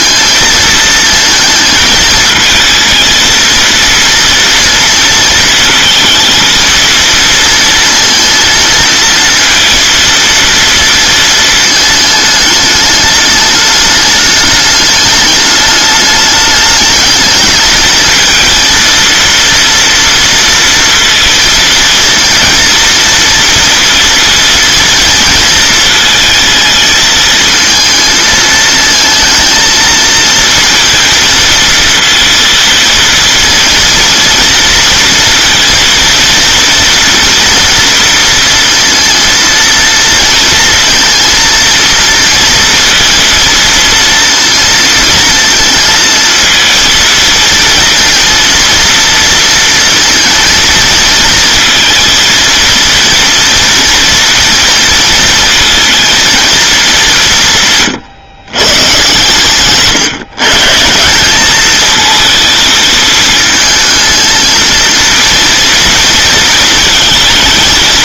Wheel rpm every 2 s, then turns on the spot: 220, 220, 230, 230, 230, 230, 210, 210, 210, 230, 230, 230, 230, 220, 220, 230, 230, 230, 230, 230, 230, 230, 230, 230, 230, 230, 230, 230, 190, 120, 170, 220, 230, 230.
none